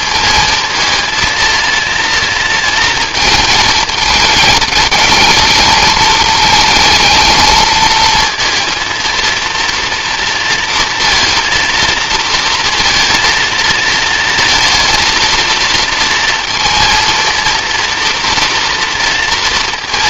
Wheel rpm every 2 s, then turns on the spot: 230, 230, 210, 220, 230, 230, 230, 230, 230, 230.
none